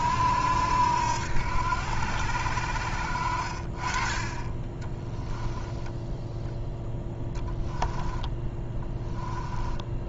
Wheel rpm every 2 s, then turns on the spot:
80, 70, 20, 10, 10.
4-6 8-10